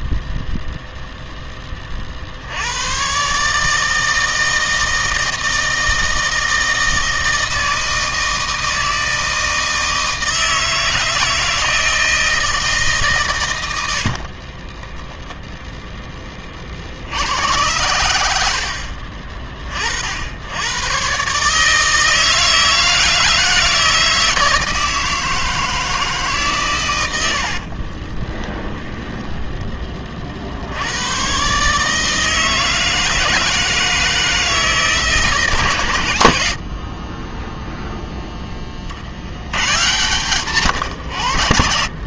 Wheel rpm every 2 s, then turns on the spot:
0, 70, 160, 160, 160, 160, 160, 50, 30, 80, 90, 160, 160, 150, 10, 60, 160, 160, 80, 20, 140.
14-16 28-30